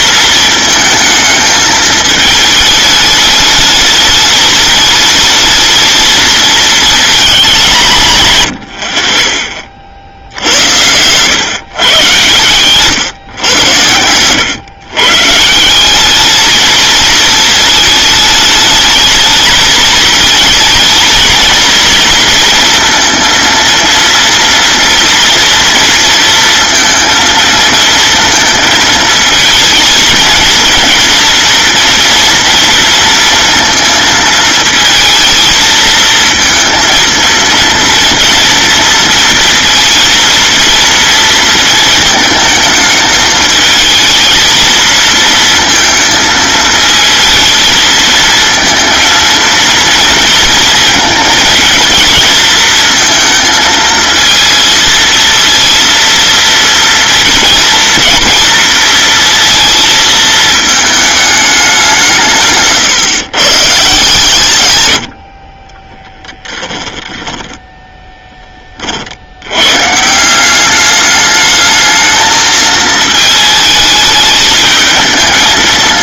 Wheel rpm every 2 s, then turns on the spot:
220, 210, 210, 220, 100, 90, 130, 120, 220, 220, 220, 230, 230, 230, 230, 230, 230, 220, 230, 240, 230, 220, 220, 220, 220, 230, 230, 230, 230, 230, 220, 140, 120, 10, 20, 190, 220, 210.
8-10 12-14 66-68